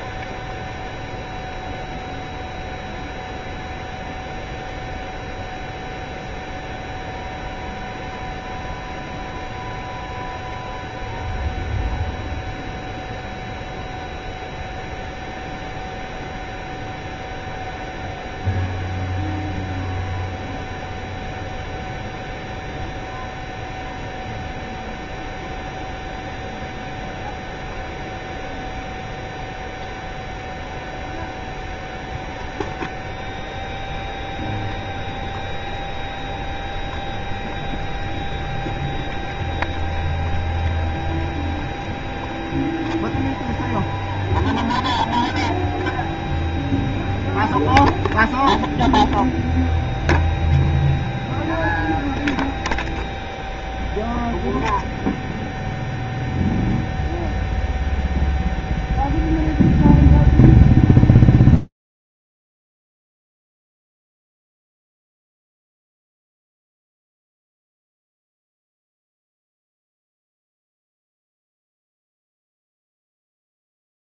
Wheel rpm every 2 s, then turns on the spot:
0, 0, 0, 0, 0, 0, 0, 0, 0, 0, 0, 0, 0, 0, 0, 0, 0, 0, 0, 0, 0, 0, 0, 0, 0, 0, 0, 0, 0, 0, 0, 0, 0, 0, 0, 0, 0.
none